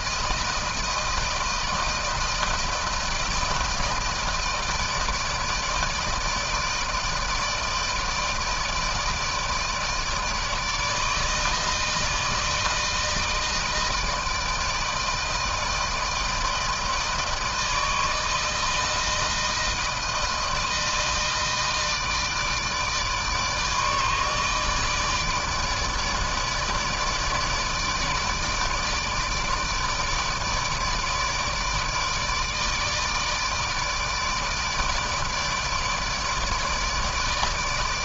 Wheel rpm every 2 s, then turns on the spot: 160, 160, 160, 160, 160, 160, 160, 160, 160, 160, 160, 160, 160, 150, 150, 150, 150, 150, 150.
none